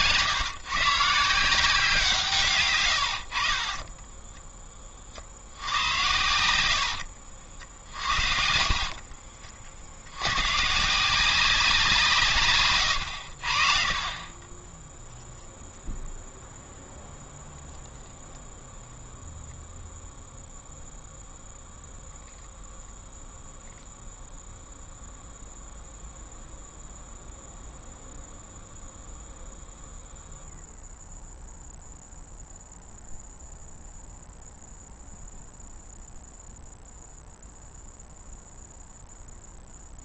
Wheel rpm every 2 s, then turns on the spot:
140, 110, 30, 90, 40, 150, 130, 10, 0, 0, 0, 0, 0, 0, 0, 0, 0, 0, 0, 0.
2-4 6-10 12-14